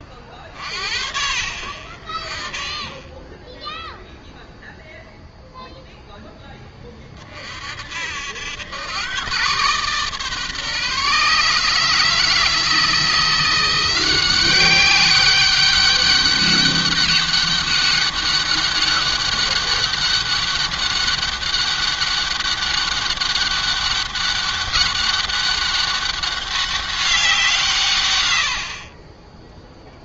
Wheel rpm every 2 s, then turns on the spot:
50, 20, 0, 20, 110, 150, 170, 190, 200, 200, 200, 200, 200, 190, 50.
none